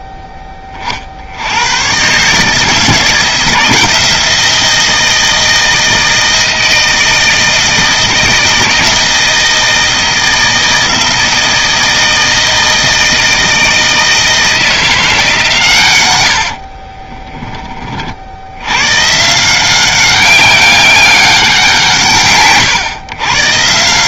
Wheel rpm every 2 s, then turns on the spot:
30, 160, 160, 160, 160, 160, 160, 170, 40, 100, 190, 110.
16-18